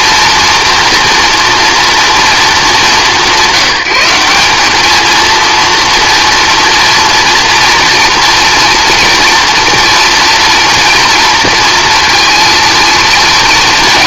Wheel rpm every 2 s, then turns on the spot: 230, 210, 220, 230, 230, 230, 230.
none